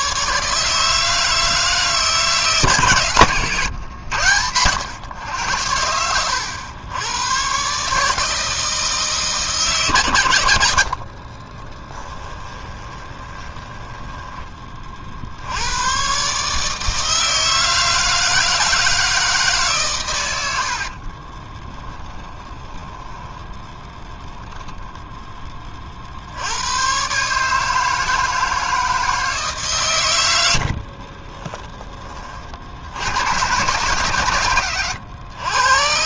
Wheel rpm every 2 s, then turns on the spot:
150, 150, 100, 100, 160, 80, 20, 30, 150, 160, 80, 10, 10, 120, 160, 70, 60, 100.
12-14 20-26 30-32